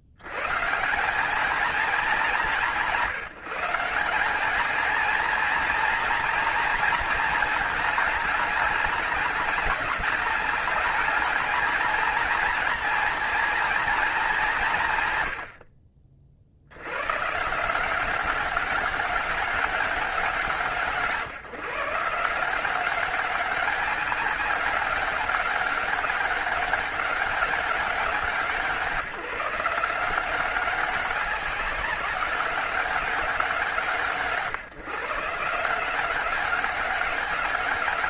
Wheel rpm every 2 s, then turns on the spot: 170, 180, 220, 230, 210, 220, 230, 110, 110, 200, 160, 190, 190, 200, 180, 190, 190, 150, 200.
none